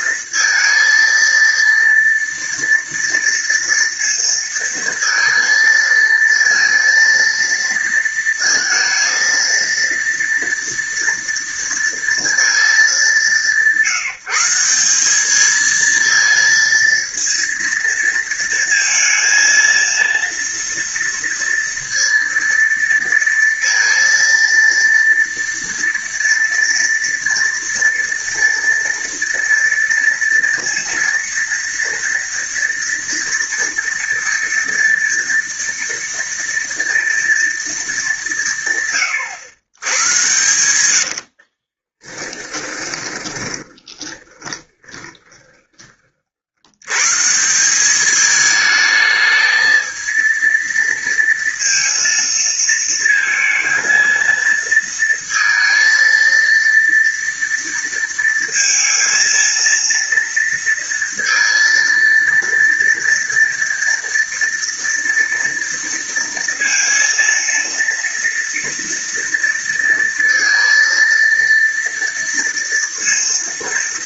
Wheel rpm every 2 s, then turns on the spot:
230, 230, 230, 230, 230, 230, 200, 180, 230, 230, 230, 230, 230, 230, 230, 230, 230, 230, 230, 140, 100, 20, 30, 80, 220, 230, 230, 230, 230, 230, 230, 230, 230, 230, 230, 230, 230.
40-46